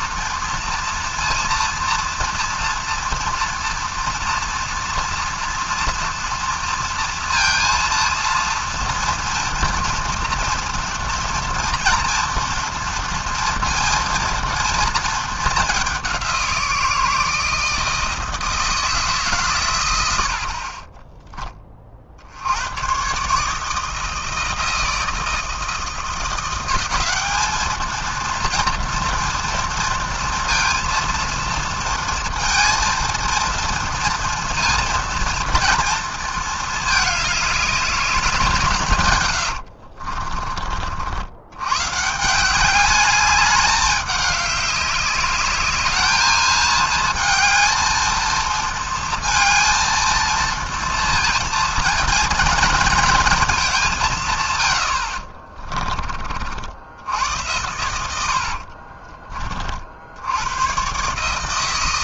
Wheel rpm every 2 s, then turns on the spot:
230, 230, 230, 230, 240, 230, 230, 230, 170, 160, 40, 100, 160, 190, 230, 230, 230, 230, 210, 150, 40, 200, 200, 220, 220, 230, 230, 110, 80, 60, 120.
58-60